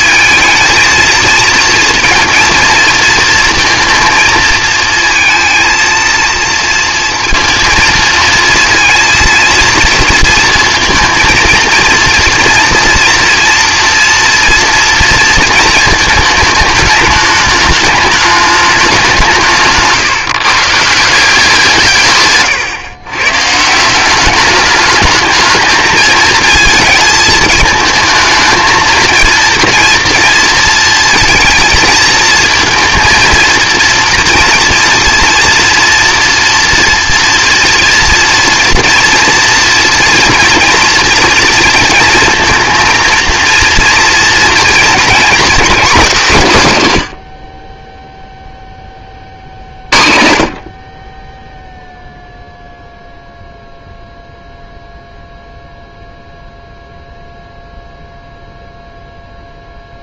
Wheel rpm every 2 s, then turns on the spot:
220, 230, 230, 230, 230, 230, 230, 230, 220, 210, 150, 150, 180, 220, 220, 230, 230, 230, 230, 230, 230, 220, 230, 240, 0, 60, 0, 0, 0, 0.
none